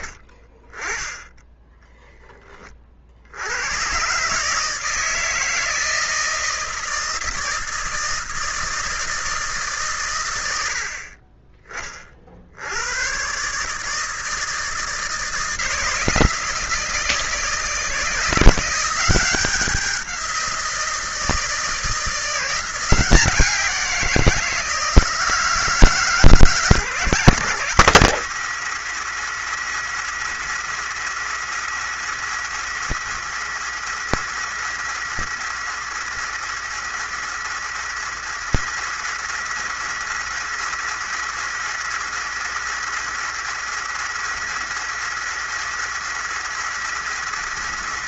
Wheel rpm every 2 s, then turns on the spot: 50, 30, 140, 160, 160, 100, 60, 160, 170, 170, 180, 170, 170, 160, 220, 220, 230, 220, 220, 230, 230, 230, 230, 230.
none